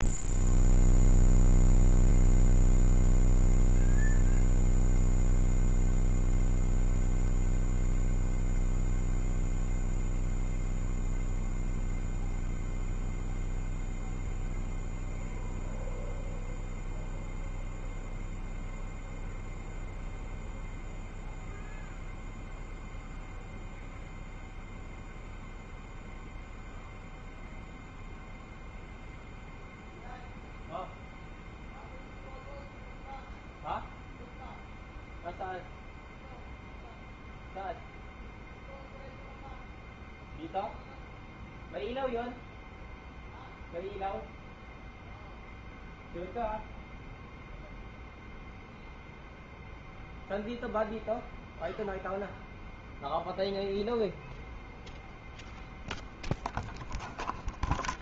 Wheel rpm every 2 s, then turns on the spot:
0, 0, 0, 0, 0, 0, 0, 0, 0, 0, 0, 0, 0, 0, 0, 0, 0, 0, 0, 0, 0, 0, 0, 0, 0, 0, 0, 0, 0.
none